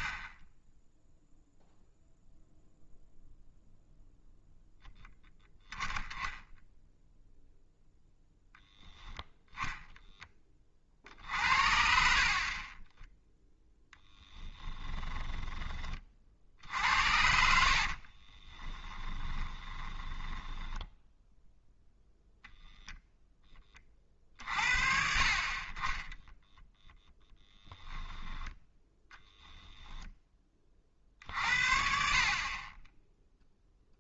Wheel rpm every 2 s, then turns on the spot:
10, 0, 10, 0, 0, 40, 20, 10, 70, 20, 10, 0, 50, 0, 10, 40, 20.
14-16 18-22